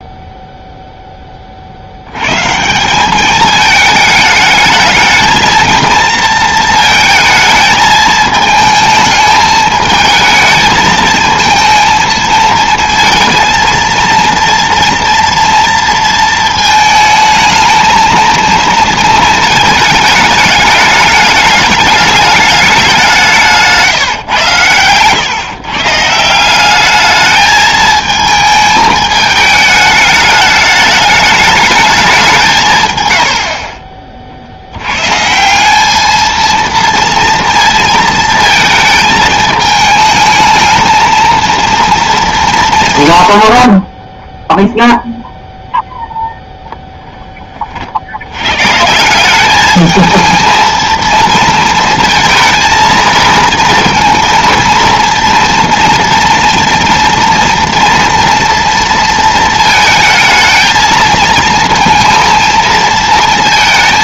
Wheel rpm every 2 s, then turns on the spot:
0, 170, 220, 220, 220, 220, 220, 230, 220, 220, 210, 200, 110, 190, 220, 210, 160, 70, 230, 230, 220, 170, 0, 0, 130, 220, 230, 230, 230, 230, 220, 230.
none